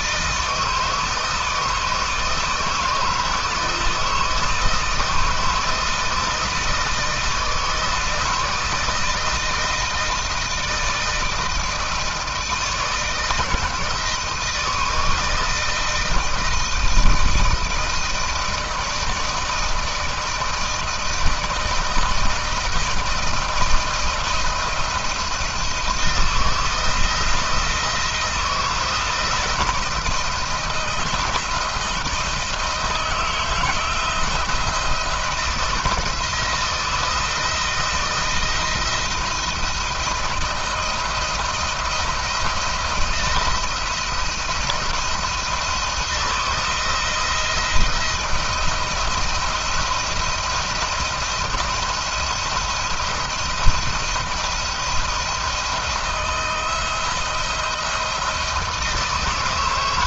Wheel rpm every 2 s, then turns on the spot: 160, 160, 160, 160, 160, 160, 160, 160, 160, 160, 160, 160, 170, 170, 170, 170, 160, 170, 170, 170, 160, 170, 160, 170, 170, 170, 170, 170, 160, 160.
none